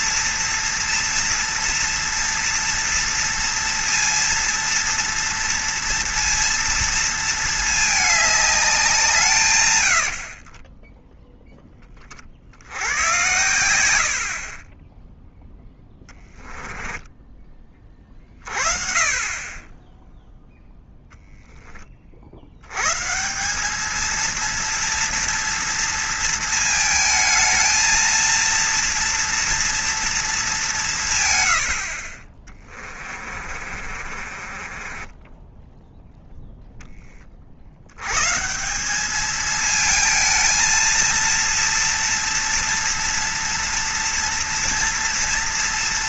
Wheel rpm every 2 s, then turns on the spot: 230, 240, 230, 230, 190, 30, 80, 20, 10, 30, 0, 100, 230, 230, 230, 200, 20, 30, 0, 180, 230, 230, 230.
16-18 32-36